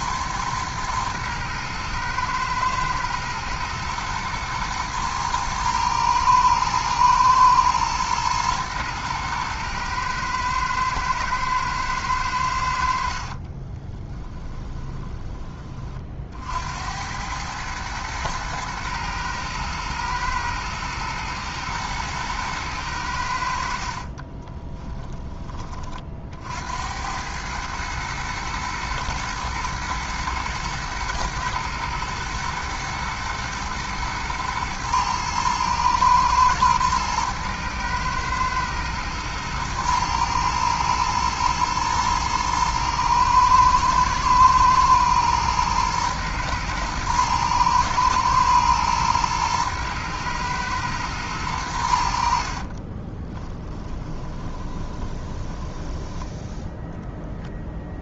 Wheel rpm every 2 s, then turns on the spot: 110, 110, 120, 110, 110, 110, 80, 20, 70, 110, 110, 110, 20, 80, 110, 110, 110, 110, 110, 110, 110, 120, 110, 110, 120, 120, 40, 20, 0.
14-16 24-26 52-56